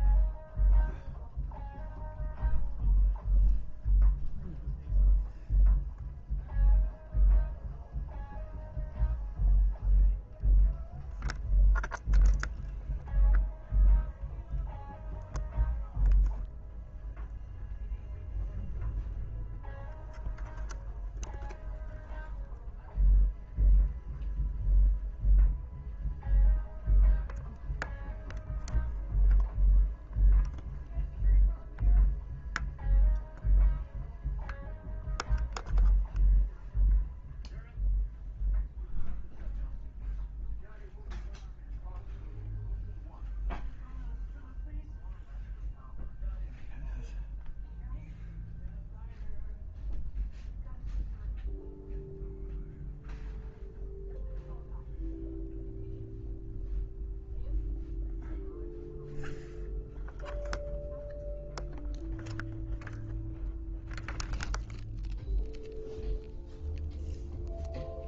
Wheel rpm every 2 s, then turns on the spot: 0, 0, 0, 0, 0, 0, 0, 0, 0, 0, 0, 0, 0, 0, 0, 0, 0, 0, 0, 0, 0, 0, 0, 0, 0, 0, 0, 0, 0, 0, 0, 0, 0, 0.
none